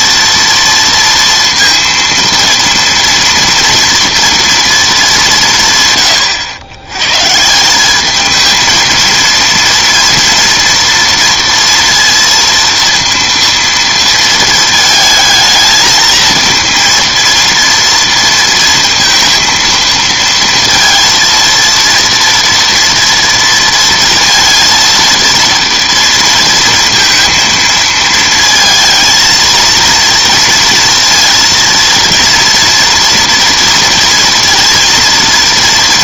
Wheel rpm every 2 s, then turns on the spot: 230, 230, 220, 100, 220, 230, 230, 220, 230, 230, 230, 230, 230, 230, 230, 230, 230, 230.
none